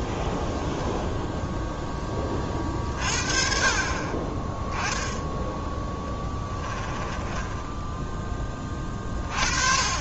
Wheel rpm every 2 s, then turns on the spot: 0, 40, 10, 10, 20.
6-8